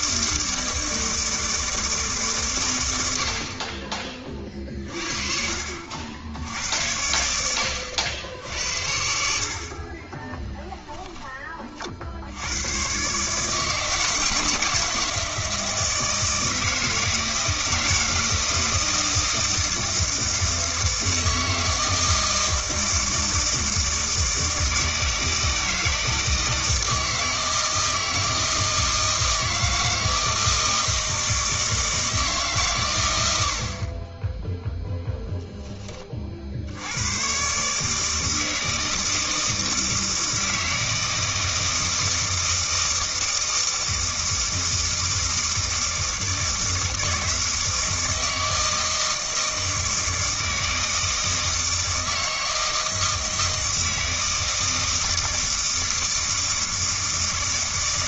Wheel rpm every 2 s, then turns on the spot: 160, 110, 40, 90, 70, 10, 120, 160, 160, 160, 160, 160, 160, 160, 160, 160, 130, 0, 70, 160, 160, 160, 160, 160, 160, 160, 160, 160, 160.
none